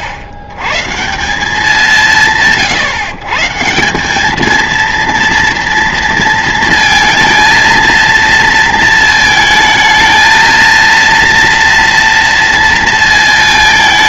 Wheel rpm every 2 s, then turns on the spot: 100, 140, 220, 230, 230, 230, 230.
none